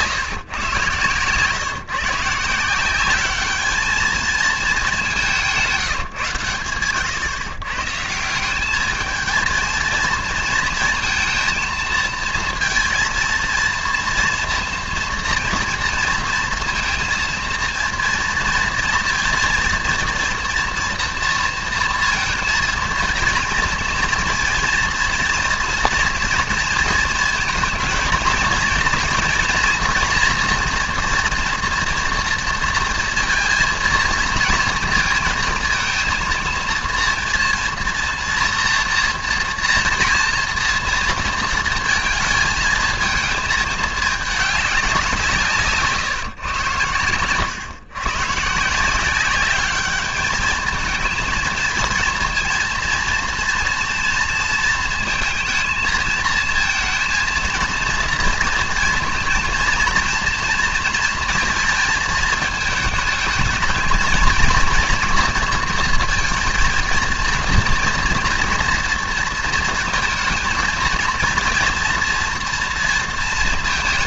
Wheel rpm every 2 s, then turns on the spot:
130, 170, 220, 120, 200, 230, 230, 230, 230, 230, 240, 230, 230, 230, 230, 230, 230, 230, 230, 230, 230, 220, 200, 130, 150, 220, 230, 230, 230, 230, 230, 220, 230, 230, 220, 220, 230.
none